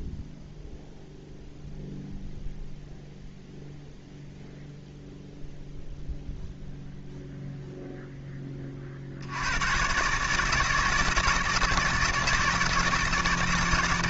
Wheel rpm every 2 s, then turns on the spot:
0, 0, 0, 0, 30, 150, 160.
none